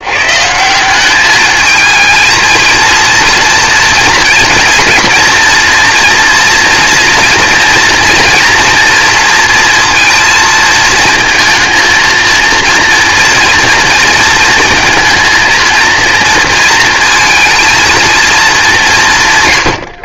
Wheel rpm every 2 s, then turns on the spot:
180, 220, 230, 230, 230, 230, 230, 220, 230, 190.
none